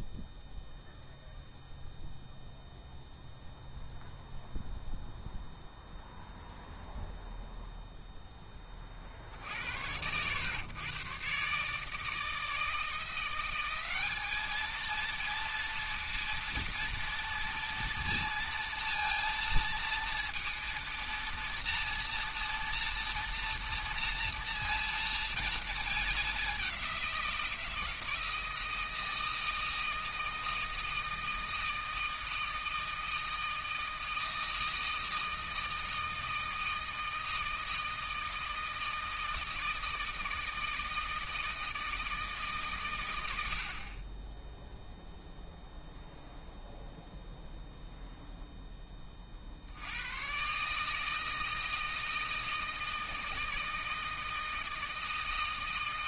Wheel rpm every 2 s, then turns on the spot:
0, 0, 0, 0, 30, 120, 160, 220, 230, 230, 230, 230, 230, 190, 160, 160, 160, 160, 160, 160, 160, 140, 0, 0, 10, 150, 160, 160.
none